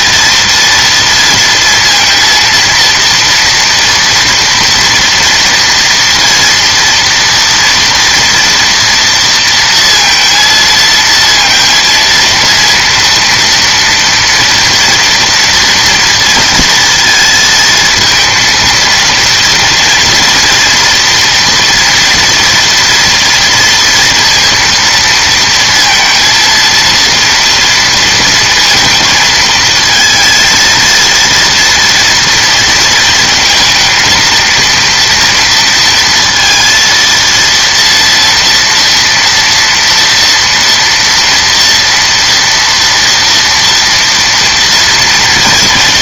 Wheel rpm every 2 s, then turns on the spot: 230, 230, 230, 230, 230, 230, 230, 230, 220, 230, 240, 230, 230, 230, 230, 230, 230, 230, 230, 230, 230, 240, 230.
none